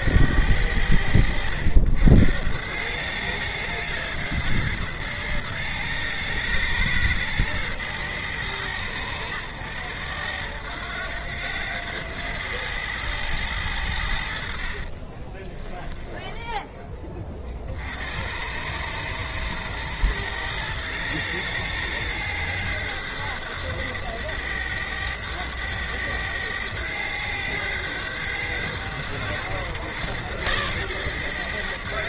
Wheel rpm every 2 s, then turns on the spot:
80, 90, 110, 110, 100, 80, 110, 60, 10, 90, 110, 110, 110, 100, 100, 110.
16-18